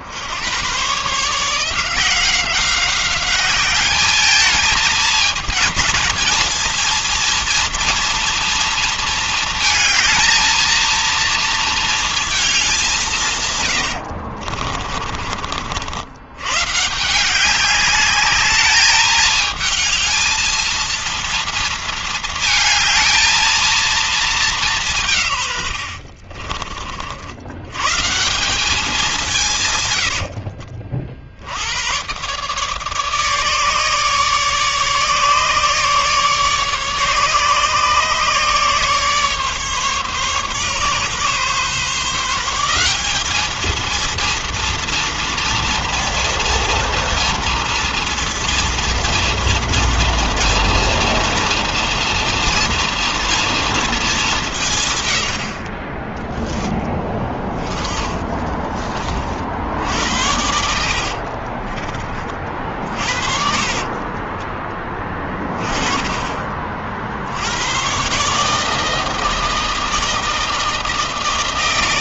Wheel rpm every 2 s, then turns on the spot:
80, 180, 220, 230, 230, 230, 220, 70, 100, 200, 220, 220, 210, 60, 170, 80, 130, 150, 150, 150, 140, 160, 230, 230, 230, 230, 230, 190, 10, 30, 70, 30, 30, 30, 140, 160.
14-16 26-28 30-32 58-62 64-66